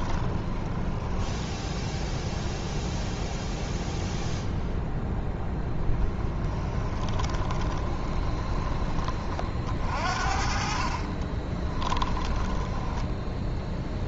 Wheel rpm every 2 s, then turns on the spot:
20, 0, 10, 20, 20, 40, 10.
0-2 6-8 12-14